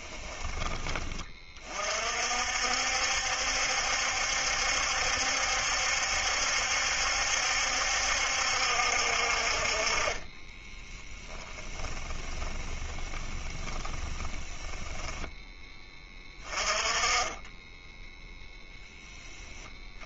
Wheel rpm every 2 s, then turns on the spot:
20, 60, 70, 70, 60, 10, 20, 10, 20, 10.
10-16